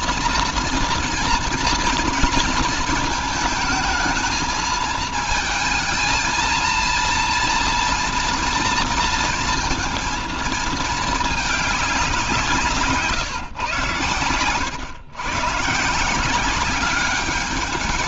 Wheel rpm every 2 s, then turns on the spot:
230, 230, 220, 230, 230, 230, 160, 110, 190.
none